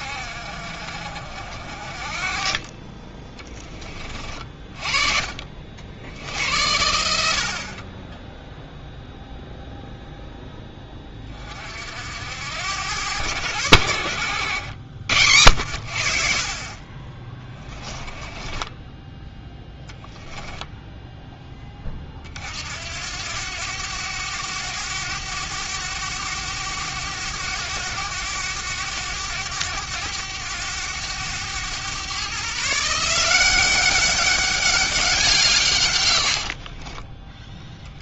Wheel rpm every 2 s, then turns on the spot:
50, 30, 40, 80, 0, 10, 80, 90, 30, 10, 10, 60, 100, 100, 100, 100, 140, 200, 50.
18-22 36-38